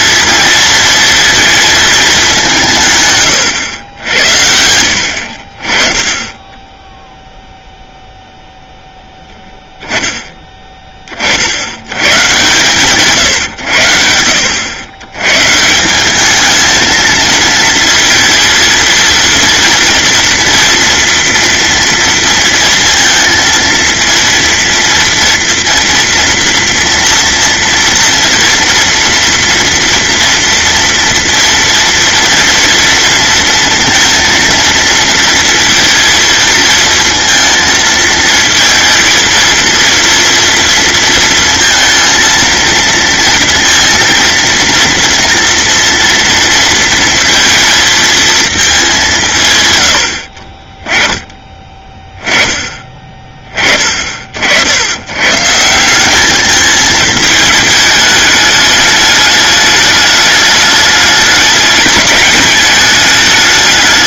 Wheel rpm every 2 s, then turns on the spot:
230, 150, 60, 10, 0, 30, 150, 100, 220, 230, 230, 230, 230, 230, 230, 230, 230, 230, 230, 230, 230, 230, 230, 230, 200, 20, 20, 100, 220, 210, 210, 210.
none